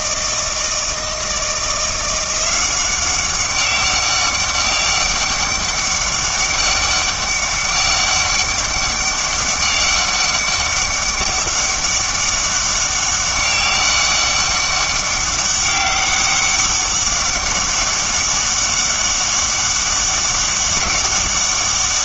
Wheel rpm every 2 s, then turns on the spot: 160, 180, 200, 200, 200, 200, 200, 200, 200, 200, 200.
none